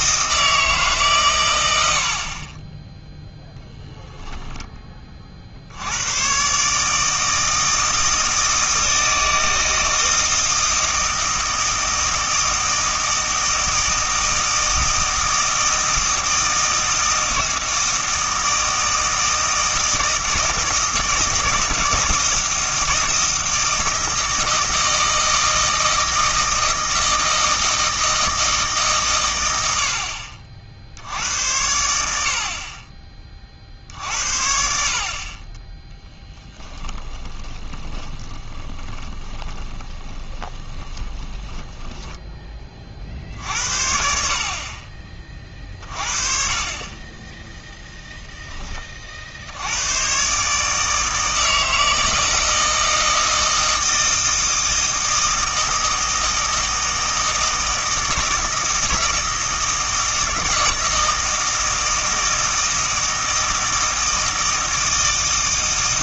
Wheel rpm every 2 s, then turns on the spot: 150, 10, 10, 140, 160, 160, 160, 160, 160, 160, 160, 160, 160, 160, 150, 70, 30, 50, 10, 20, 20, 30, 30, 30, 30, 150, 160, 160, 160, 160, 160, 160, 160.
36-42